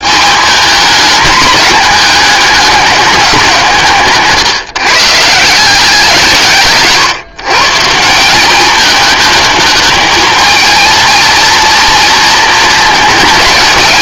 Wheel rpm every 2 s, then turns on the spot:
220, 200, 140, 150, 210, 230, 220.
none